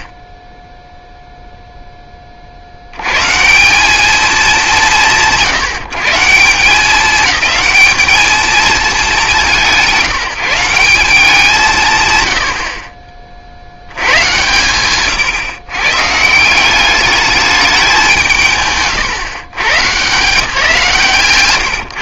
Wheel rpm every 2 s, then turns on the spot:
0, 50, 140, 200, 220, 180, 60, 130, 190, 140, 160.
none